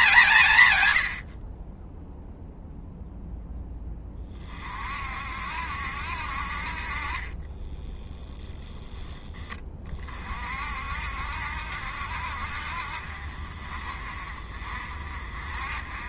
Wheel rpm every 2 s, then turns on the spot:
110, 0, 40, 40, 0, 50, 50, 50.
none